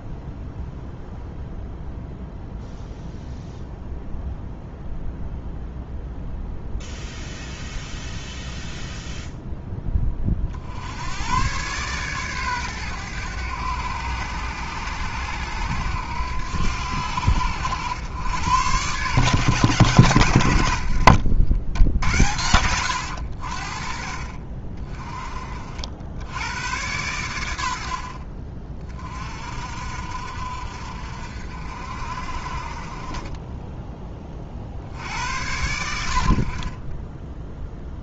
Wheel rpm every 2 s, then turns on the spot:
0, 0, 0, 0, 0, 80, 110, 90, 80, 110, 70, 90, 30, 100, 40, 60, 40, 70, 20.
none